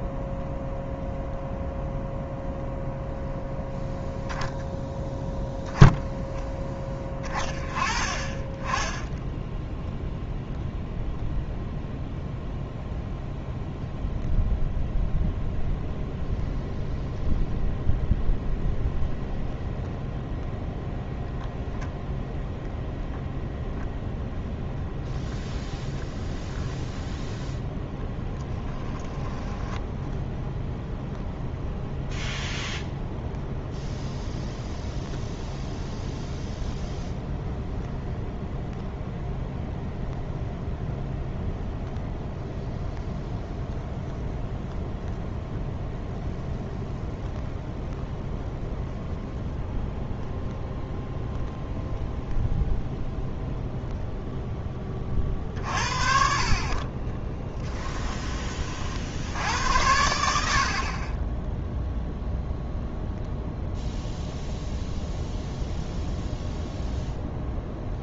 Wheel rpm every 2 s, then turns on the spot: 0, 0, 0, 10, 10, 0, 0, 0, 0, 0, 0, 0, 0, 0, 10, 0, 0, 0, 0, 0, 0, 0, 0, 0, 0, 0, 0, 20, 30, 50, 40, 0, 0, 0.
28-30